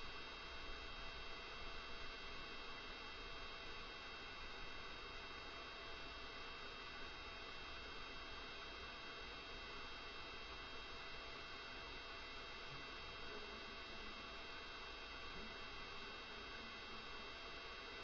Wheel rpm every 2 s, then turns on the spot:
0, 0, 0, 0, 0, 0, 0, 0, 0.
none